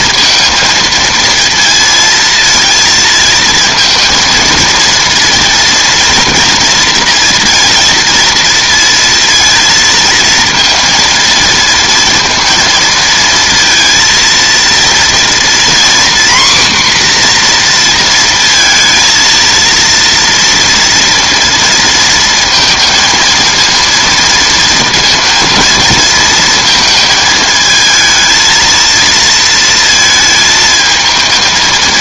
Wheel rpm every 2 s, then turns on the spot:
230, 230, 230, 230, 230, 230, 230, 230, 250, 230, 230, 230, 230, 230, 230, 220.
none